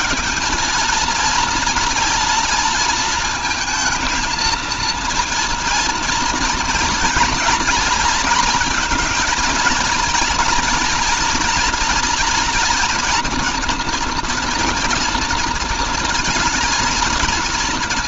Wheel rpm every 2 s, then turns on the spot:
220, 230, 230, 230, 230, 230, 240, 230, 220.
none